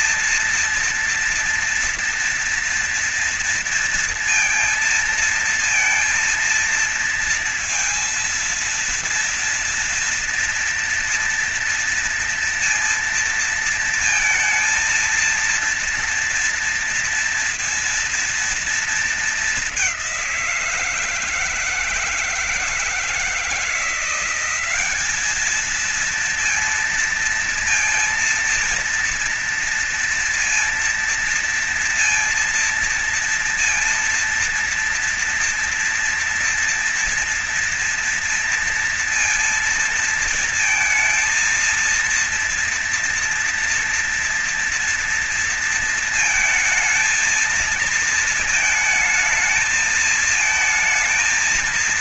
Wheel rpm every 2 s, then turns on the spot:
230, 230, 230, 230, 230, 230, 230, 230, 230, 230, 170, 160, 200, 230, 230, 230, 230, 230, 230, 230, 230, 230, 230, 230, 220, 220.
none